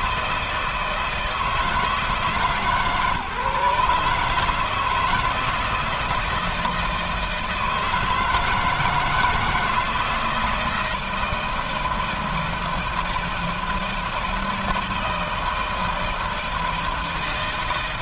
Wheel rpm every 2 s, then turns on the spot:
160, 150, 160, 160, 160, 160, 160, 160, 160.
none